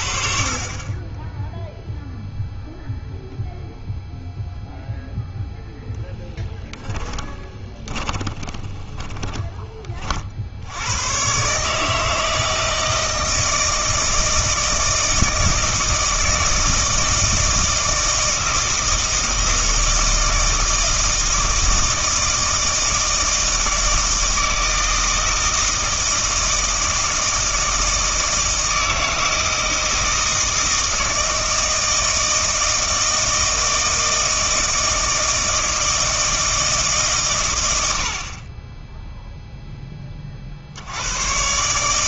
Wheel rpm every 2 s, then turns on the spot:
30, 0, 0, 10, 20, 90, 160, 160, 160, 160, 160, 160, 160, 160, 160, 160, 160, 160, 160, 20, 70.
6-10